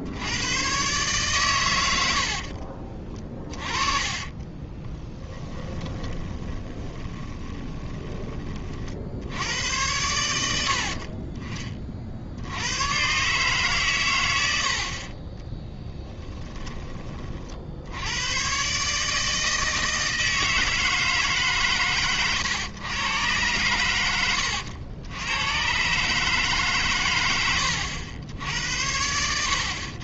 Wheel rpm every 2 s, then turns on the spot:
130, 30, 20, 20, 50, 70, 110, 60, 20, 140, 160, 110, 90, 140, 80.
2-8